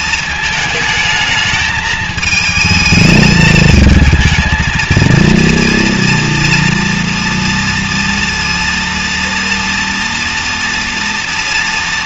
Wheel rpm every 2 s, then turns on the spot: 220, 220, 220, 230, 230, 230.
none